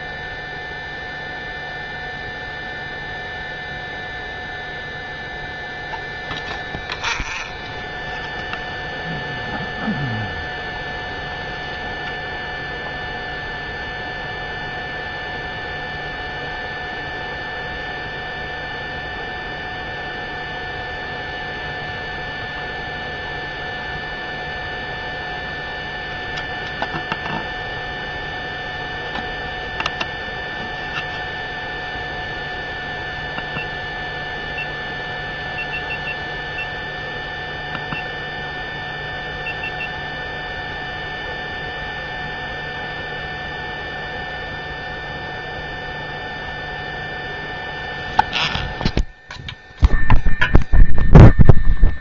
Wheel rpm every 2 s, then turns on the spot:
0, 0, 0, 0, 0, 0, 0, 0, 0, 0, 0, 0, 0, 0, 0, 0, 0, 0, 0, 0, 0, 0, 0, 0, 0, 0.
none